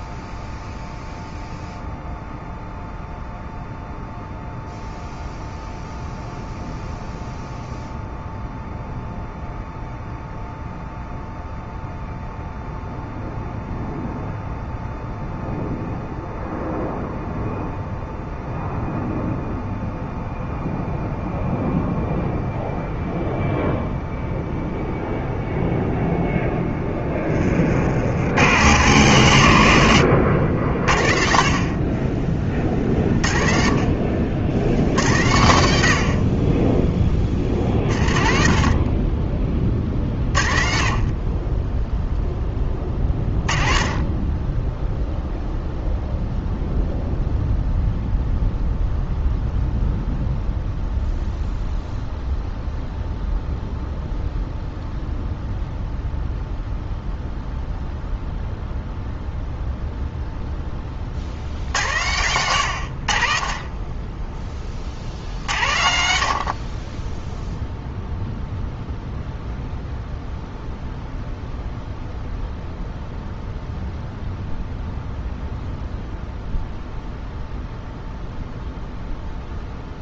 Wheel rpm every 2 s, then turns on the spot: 0, 0, 0, 0, 0, 0, 0, 0, 0, 0, 0, 0, 0, 10, 110, 60, 40, 120, 20, 40, 40, 20, 0, 0, 0, 0, 0, 0, 0, 0, 40, 80, 40, 20, 0, 0, 0, 0, 0, 0.
none